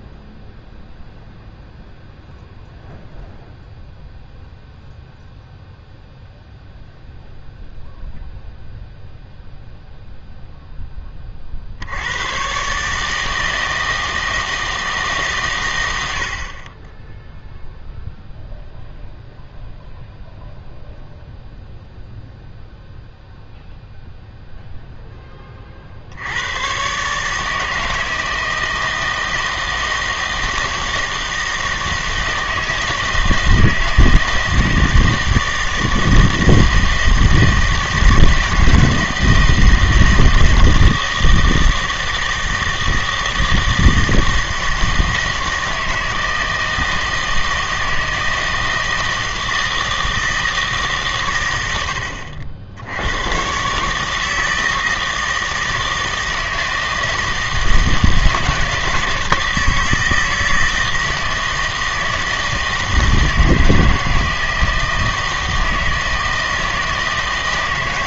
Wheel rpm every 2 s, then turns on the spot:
0, 0, 0, 0, 0, 10, 130, 160, 30, 0, 0, 0, 0, 110, 160, 160, 160, 160, 160, 160, 160, 160, 160, 160, 160, 150, 70, 160, 160, 160, 160, 160, 160, 160.
none